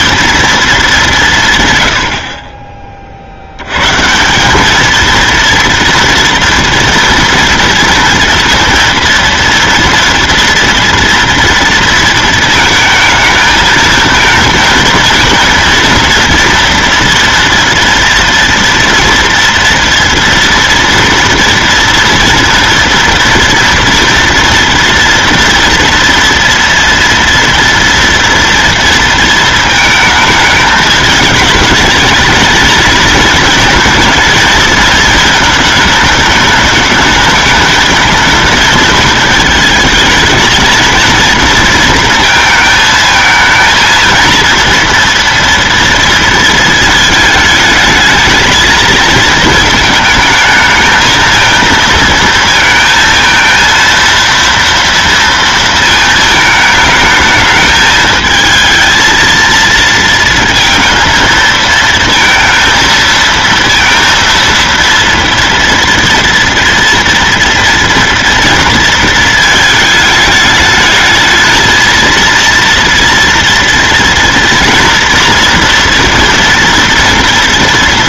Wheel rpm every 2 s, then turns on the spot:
220, 20, 200, 230, 230, 230, 220, 230, 230, 230, 230, 230, 230, 230, 230, 210, 220, 230, 210, 220, 220, 230, 230, 220, 220, 220, 230, 230, 220, 220, 230, 230, 230, 230, 230, 210, 230, 240, 230.
none